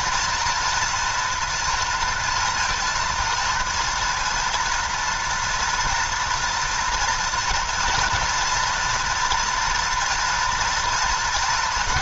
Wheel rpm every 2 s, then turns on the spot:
240, 230, 240, 230, 230, 230.
none